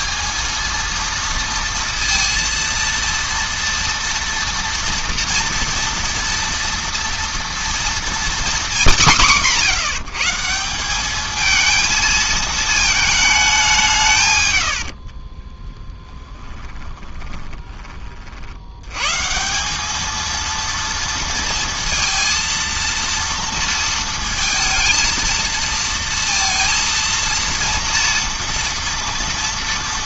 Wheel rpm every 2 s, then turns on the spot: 220, 230, 230, 230, 210, 170, 220, 100, 10, 80, 230, 230, 230, 230, 230.
16-18